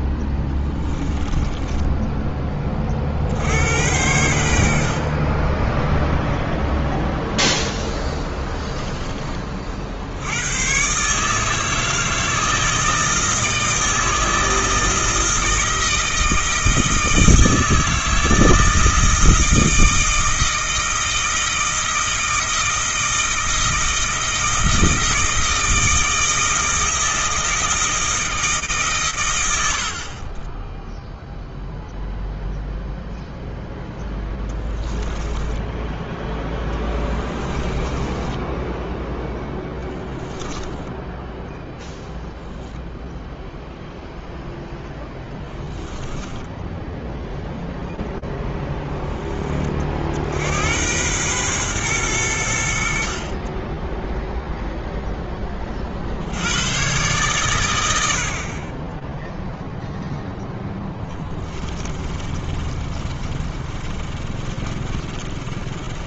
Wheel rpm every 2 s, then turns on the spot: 10, 20, 70, 0, 10, 100, 160, 160, 160, 160, 160, 160, 160, 160, 160, 40, 0, 10, 10, 20, 10, 0, 0, 10, 10, 90, 80, 0, 110, 10, 20, 30, 40.
0-2 8-10 34-36 38-40 46-48 60-66